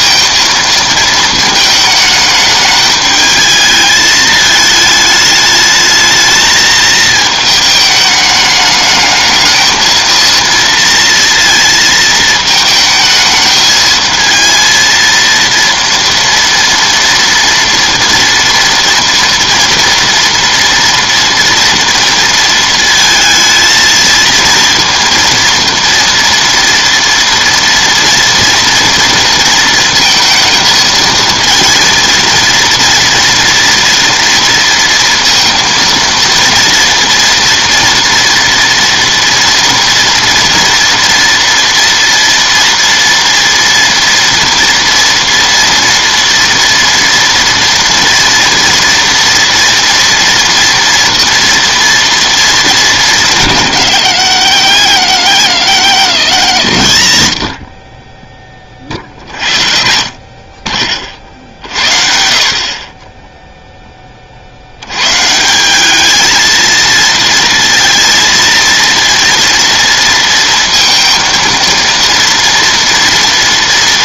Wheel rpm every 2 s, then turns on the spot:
220, 210, 220, 220, 210, 230, 220, 230, 230, 230, 230, 230, 230, 230, 230, 230, 230, 230, 230, 240, 230, 230, 230, 230, 230, 230, 220, 110, 80, 30, 50, 40, 70, 230, 230, 230, 230.
none